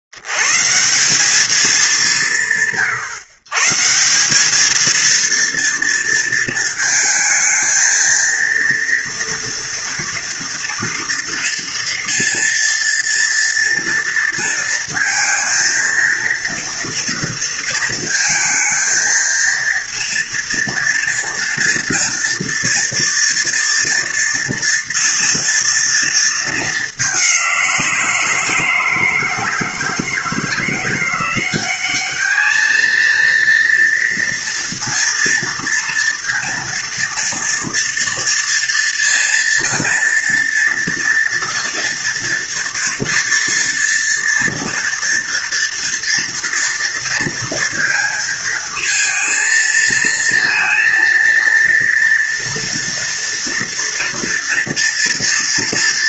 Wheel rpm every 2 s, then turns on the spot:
50, 180, 180, 230, 230, 230, 230, 230, 230, 230, 230, 230, 230, 220, 170, 160, 210, 230, 230, 230, 230, 240, 240, 230, 220, 230, 230, 240.
none